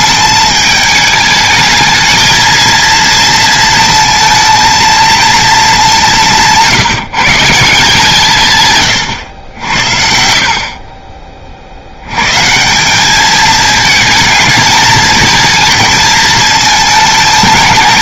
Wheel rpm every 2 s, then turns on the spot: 210, 230, 230, 170, 130, 40, 170, 220, 220.
10-12